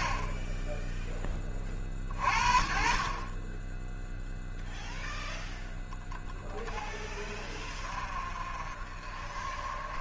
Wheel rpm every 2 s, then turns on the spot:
20, 50, 10, 10, 40.
none